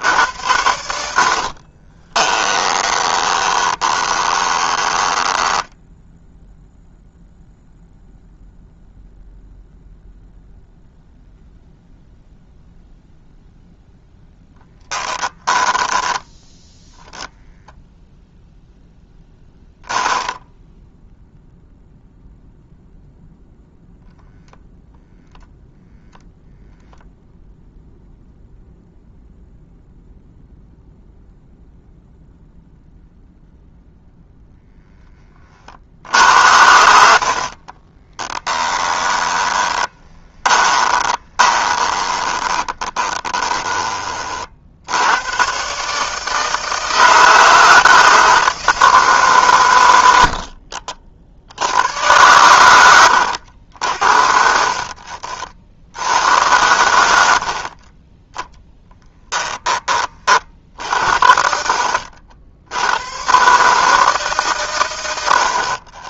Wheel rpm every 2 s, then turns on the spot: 80, 20, 20, 0, 0, 0, 0, 10, 10, 0, 0, 0, 0, 0, 0, 0, 0, 10, 70, 10, 20, 30, 70, 160, 160, 60, 90, 50, 90, 10, 50, 90, 120.
2-6 14-16 38-44 50-52 54-56